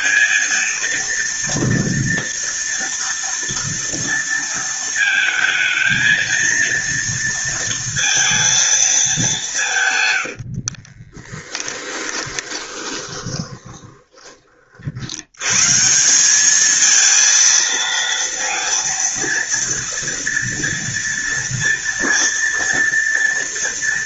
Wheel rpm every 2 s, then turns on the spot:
230, 230, 230, 230, 210, 30, 20, 70, 220, 230, 230, 230.
10-14